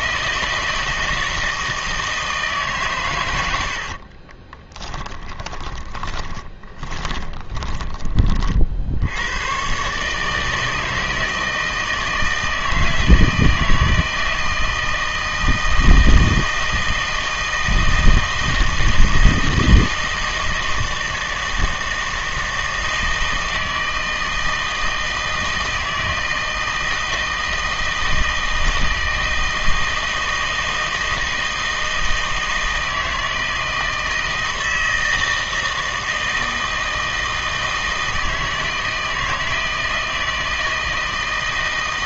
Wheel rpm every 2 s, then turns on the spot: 160, 140, 20, 20, 60, 160, 160, 160, 160, 160, 160, 160, 160, 160, 160, 160, 160, 160, 160, 160, 160.
4-8